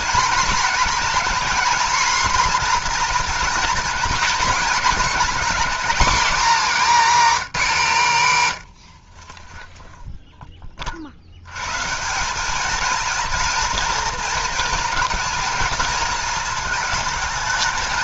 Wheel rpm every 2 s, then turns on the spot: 230, 240, 230, 260, 100, 20, 210, 220, 220.
none